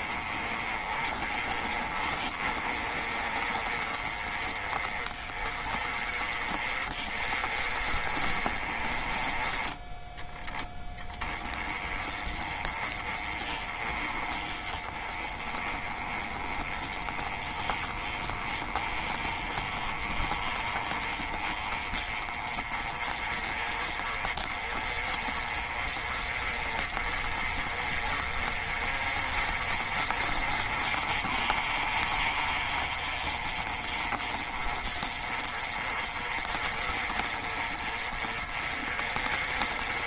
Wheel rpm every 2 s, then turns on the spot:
30, 30, 30, 30, 30, 10, 20, 20, 20, 20, 20, 30, 30, 30, 30, 30, 30, 30, 30, 30.
none